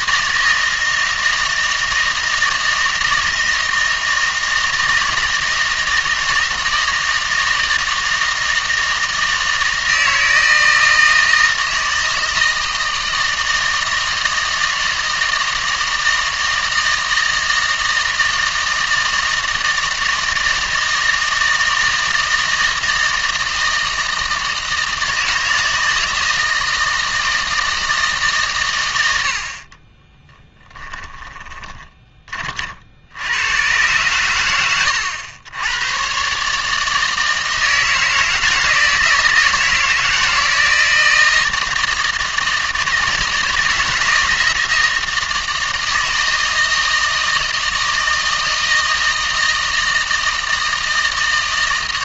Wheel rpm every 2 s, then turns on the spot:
160, 160, 160, 160, 160, 160, 160, 160, 160, 160, 160, 160, 160, 160, 110, 20, 50, 100, 150, 160, 160, 160, 160, 160, 160, 160.
30-32